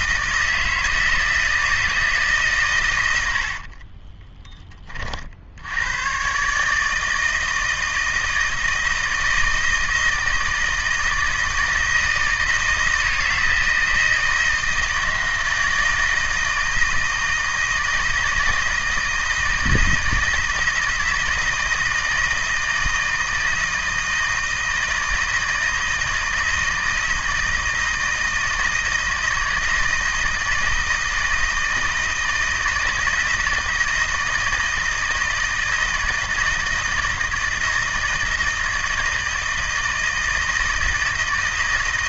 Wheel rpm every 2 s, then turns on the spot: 160, 130, 30, 150, 160, 160, 160, 160, 160, 160, 160, 160, 160, 160, 160, 160, 160, 160, 160, 160, 160.
none